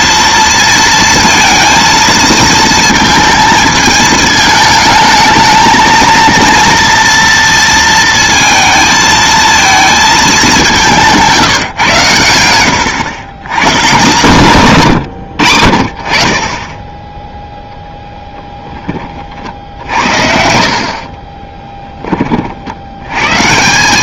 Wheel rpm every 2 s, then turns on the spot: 230, 230, 220, 230, 220, 170, 100, 130, 10, 20, 50, 80.
20-22